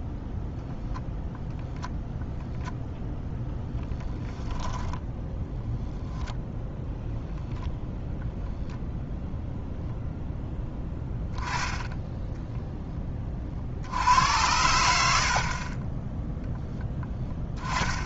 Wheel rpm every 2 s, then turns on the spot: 0, 0, 10, 0, 0, 10, 10, 80, 0.
none